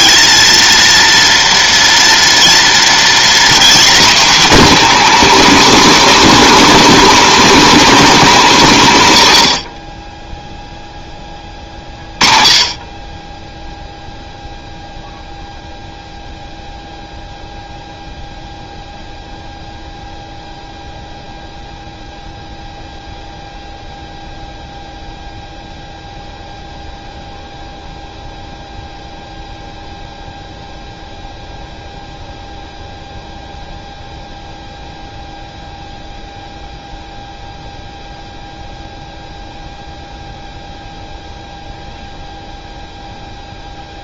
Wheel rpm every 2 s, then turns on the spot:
220, 240, 290, 310, 200, 0, 30, 0, 0, 0, 0, 0, 0, 0, 0, 0, 0, 0, 0, 0, 0, 0.
none